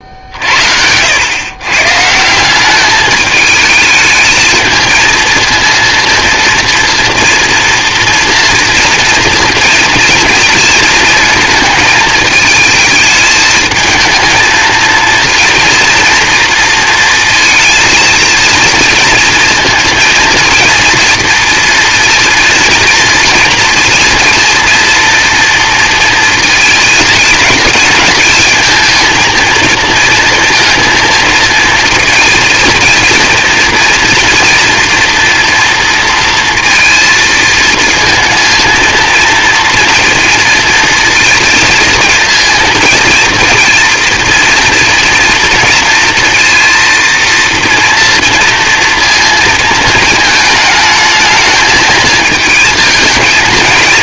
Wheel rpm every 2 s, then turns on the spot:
70, 190, 220, 230, 230, 220, 220, 220, 230, 230, 230, 230, 230, 220, 230, 230, 230, 230, 230, 230, 230, 230, 230, 230, 230, 220, 220.
none